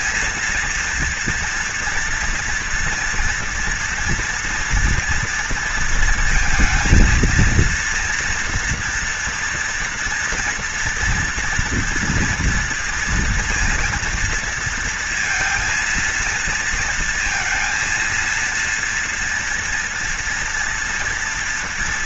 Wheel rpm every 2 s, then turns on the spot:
230, 230, 230, 230, 230, 230, 230, 230, 230, 230, 230.
none